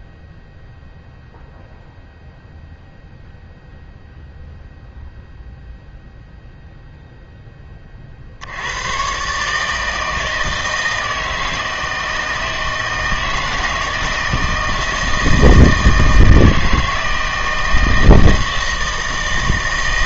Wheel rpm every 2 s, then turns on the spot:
0, 0, 0, 0, 90, 160, 160, 160, 160, 160.
none